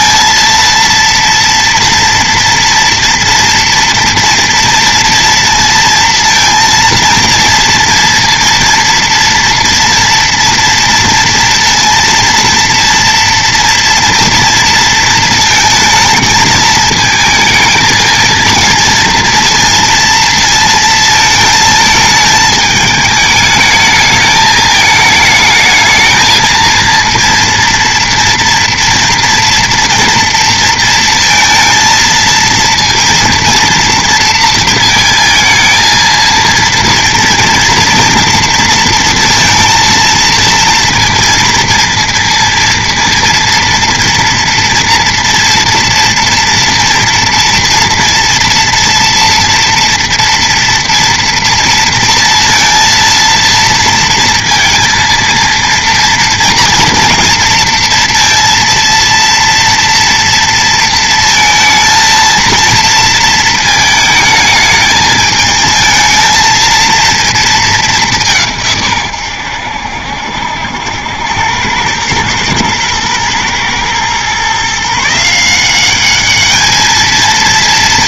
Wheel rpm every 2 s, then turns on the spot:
230, 230, 230, 230, 230, 230, 230, 230, 220, 230, 230, 210, 220, 230, 240, 230, 230, 230, 230, 230, 230, 230, 240, 230, 230, 230, 230, 230, 230, 230, 230, 230, 220, 220, 150, 70, 110, 140, 220.
none